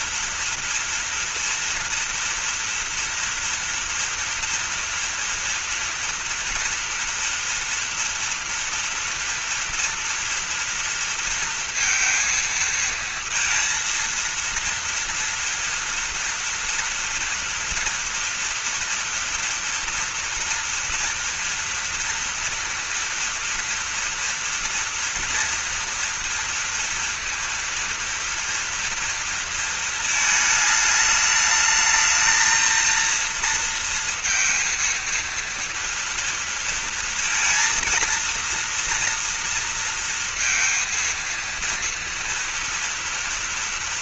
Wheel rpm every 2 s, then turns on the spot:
230, 230, 230, 240, 230, 230, 230, 230, 240, 230, 230, 230, 230, 230, 240, 220, 230, 230, 230, 230, 230, 230.
none